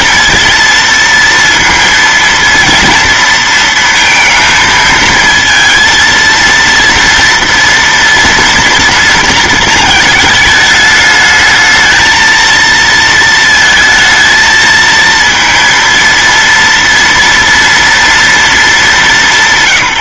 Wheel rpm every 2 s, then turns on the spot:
230, 230, 230, 230, 230, 210, 220, 220, 230, 200.
none